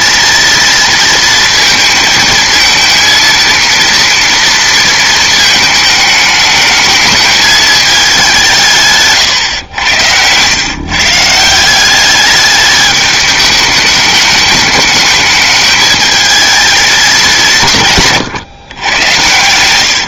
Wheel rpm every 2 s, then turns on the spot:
230, 230, 230, 220, 160, 130, 210, 210, 220, 120.
none